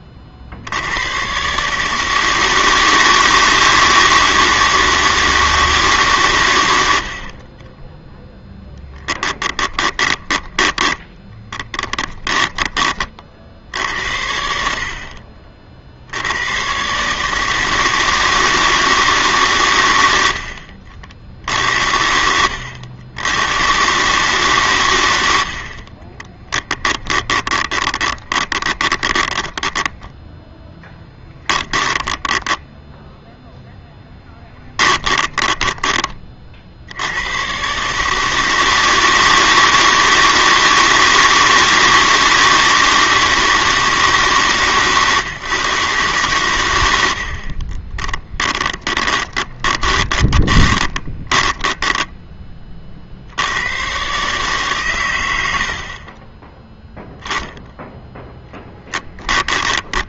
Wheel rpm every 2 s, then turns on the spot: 100, 160, 160, 70, 10, 10, 20, 60, 140, 160, 50, 90, 100, 30, 20, 10, 0, 10, 80, 160, 160, 160, 140, 80, 20, 20, 50, 120, 0, 10.
8-12 24-32 34-36 48-52 58-60